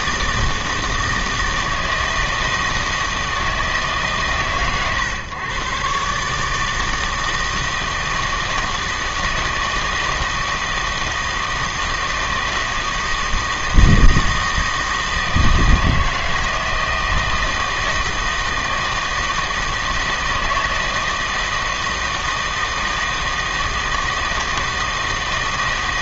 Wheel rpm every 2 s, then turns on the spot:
160, 160, 130, 160, 160, 160, 160, 160, 160, 160, 160, 160, 160.
none